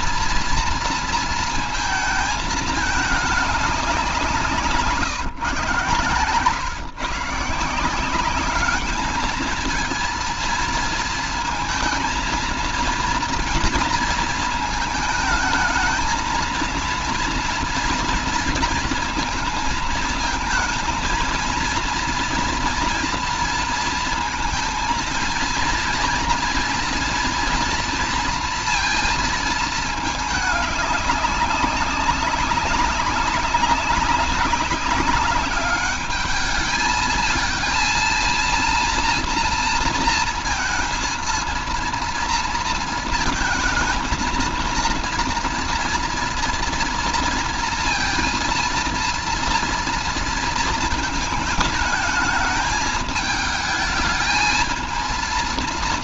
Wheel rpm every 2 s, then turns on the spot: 230, 210, 150, 150, 220, 230, 230, 220, 230, 230, 230, 230, 230, 240, 230, 200, 200, 200, 220, 230, 230, 230, 230, 230, 230, 220, 220, 220.
none